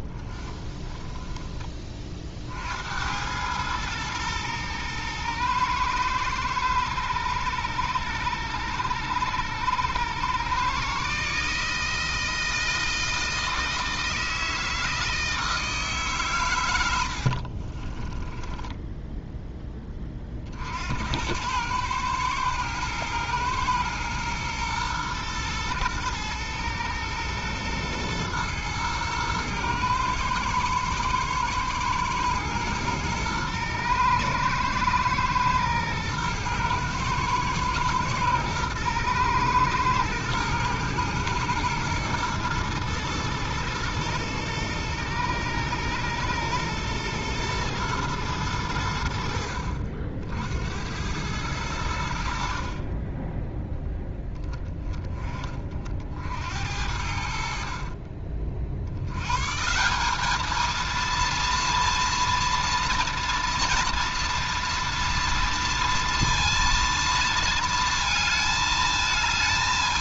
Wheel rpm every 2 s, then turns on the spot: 20, 70, 110, 100, 100, 130, 160, 160, 90, 10, 60, 110, 120, 110, 110, 110, 110, 110, 110, 120, 110, 110, 110, 120, 90, 90, 30, 20, 80, 60, 230, 230, 230, 230, 220.
0-2 18-20